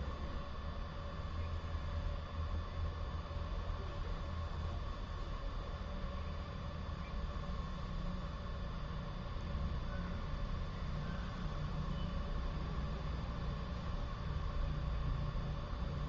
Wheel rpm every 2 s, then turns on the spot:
0, 0, 0, 0, 0, 0, 0, 0.
none